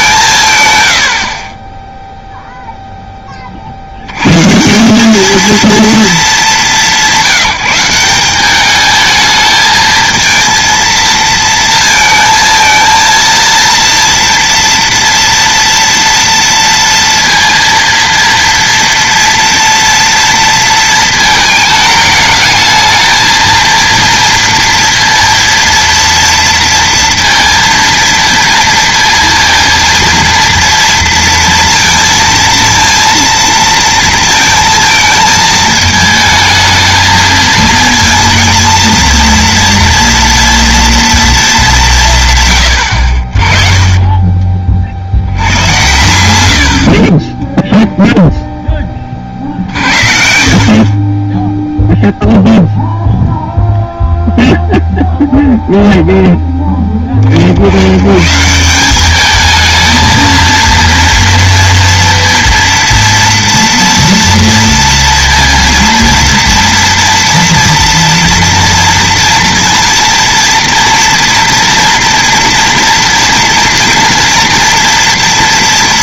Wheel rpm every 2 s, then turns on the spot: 110, 0, 170, 190, 210, 220, 230, 230, 230, 230, 230, 220, 230, 230, 230, 230, 230, 230, 220, 230, 230, 100, 40, 60, 10, 40, 0, 0, 10, 180, 230, 230, 230, 230, 230, 230, 230, 230.
46-48